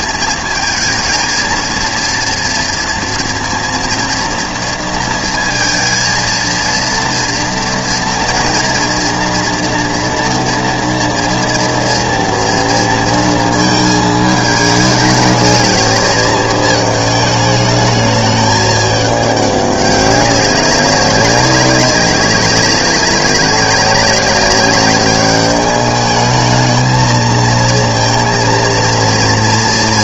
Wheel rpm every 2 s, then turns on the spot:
220, 230, 230, 230, 230, 230, 230, 210, 220, 210, 200, 200, 200, 210, 230.
none